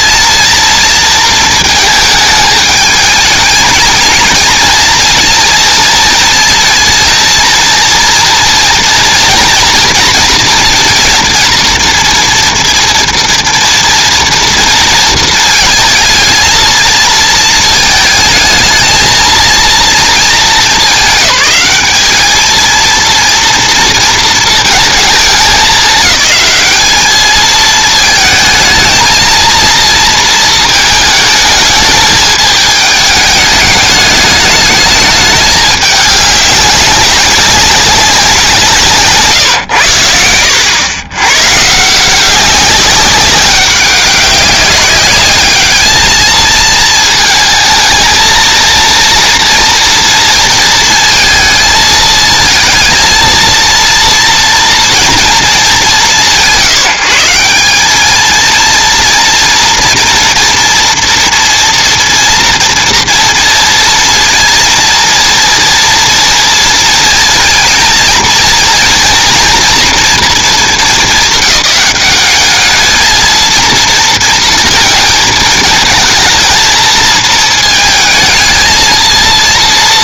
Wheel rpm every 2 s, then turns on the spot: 230, 210, 230, 230, 230, 230, 240, 230, 220, 220, 200, 220, 230, 210, 220, 220, 210, 210, 200, 170, 90, 190, 200, 220, 230, 230, 220, 230, 150, 230, 240, 230, 230, 230, 230, 230, 210, 230, 220, 230.
none